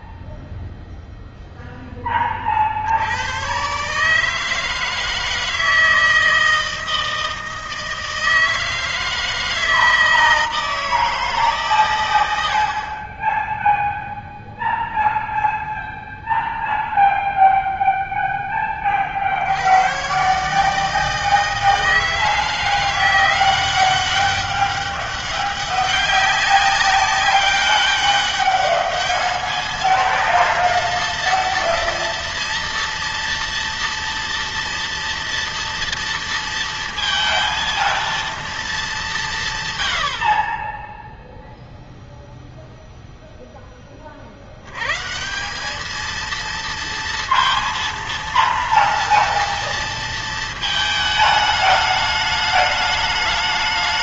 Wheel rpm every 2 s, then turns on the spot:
0, 50, 160, 160, 160, 160, 70, 0, 0, 20, 150, 160, 200, 200, 210, 230, 230, 230, 230, 220, 30, 0, 90, 230, 230, 220, 210.
none